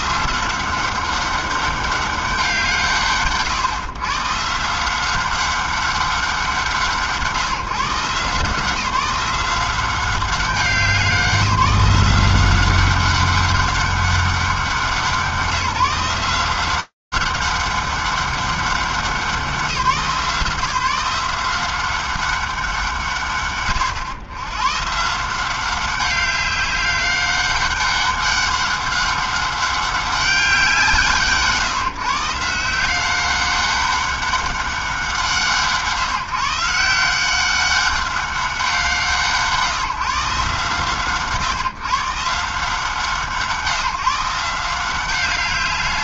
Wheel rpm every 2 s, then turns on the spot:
160, 200, 130, 200, 150, 180, 180, 200, 170, 190, 180, 190, 100, 190, 200, 200, 140, 190, 140, 190, 130, 140, 160.
none